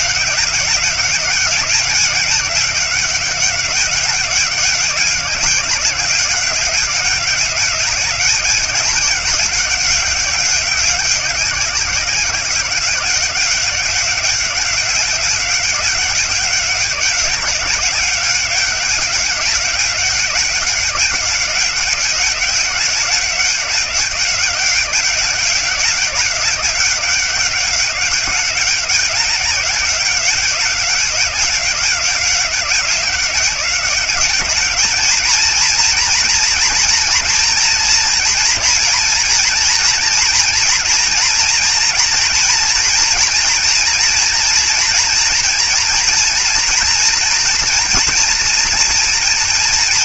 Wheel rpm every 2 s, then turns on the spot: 190, 200, 190, 190, 200, 190, 180, 190, 190, 190, 190, 190, 190, 190, 200, 190, 190, 210, 240, 230, 230, 240, 240, 230, 240.
none